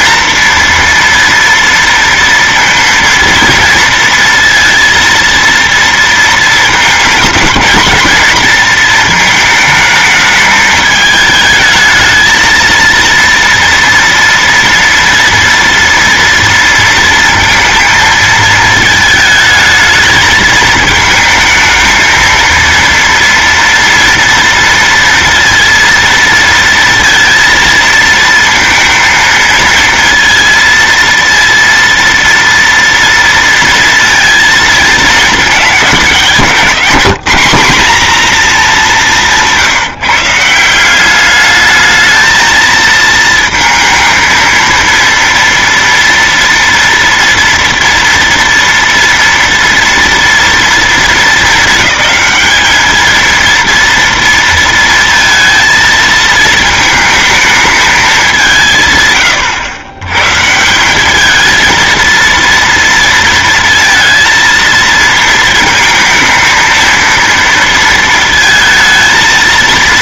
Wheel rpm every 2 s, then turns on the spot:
230, 230, 230, 220, 220, 220, 220, 230, 230, 220, 220, 230, 230, 230, 220, 230, 230, 230, 200, 220, 180, 220, 230, 230, 230, 230, 220, 230, 220, 170, 160, 230, 230, 230, 230.
36-38